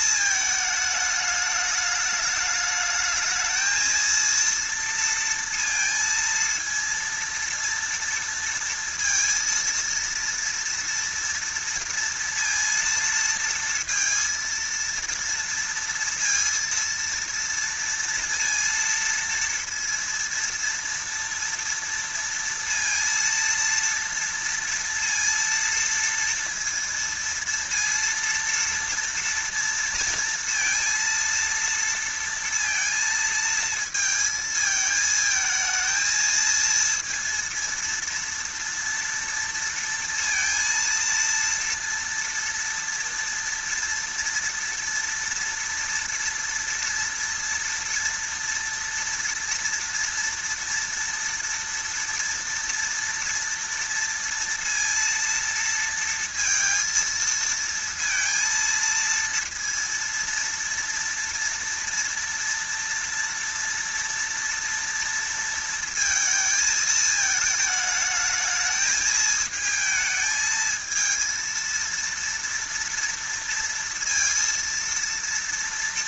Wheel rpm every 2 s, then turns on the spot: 220, 210, 230, 230, 230, 230, 230, 230, 230, 230, 230, 230, 230, 230, 230, 230, 230, 220, 230, 230, 230, 230, 230, 230, 230, 230, 240, 230, 230, 230, 230, 230, 230, 220, 210, 220, 230, 230.
none